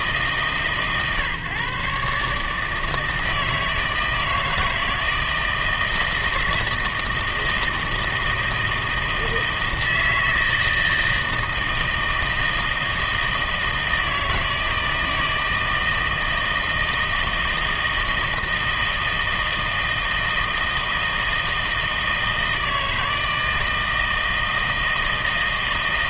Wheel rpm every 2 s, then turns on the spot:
140, 160, 160, 160, 160, 160, 160, 160, 160, 160, 160, 160, 160.
none